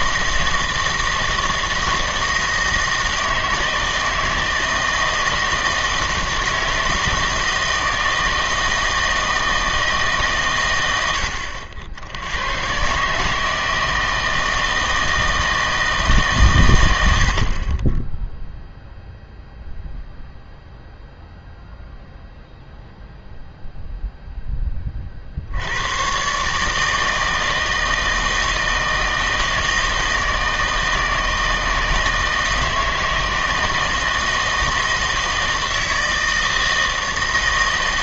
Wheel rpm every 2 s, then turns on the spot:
160, 160, 160, 160, 160, 110, 120, 160, 110, 0, 0, 0, 10, 150, 160, 160, 160, 160, 160.
none